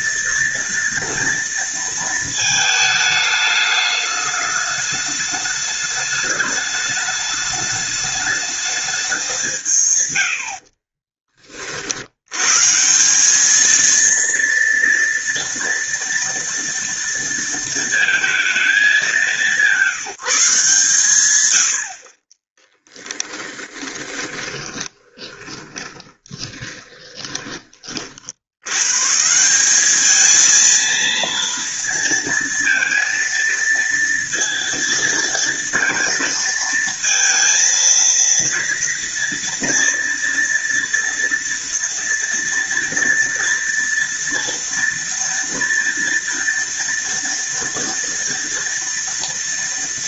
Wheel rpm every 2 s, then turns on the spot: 230, 210, 210, 210, 200, 30, 170, 230, 230, 210, 140, 20, 20, 20, 130, 230, 230, 230, 230, 230, 230, 230, 230, 230, 230.
10-12 22-28